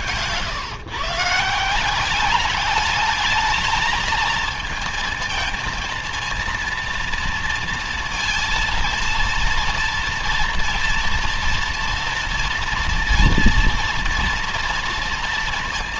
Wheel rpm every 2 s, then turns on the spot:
140, 210, 220, 230, 230, 230, 230, 230.
none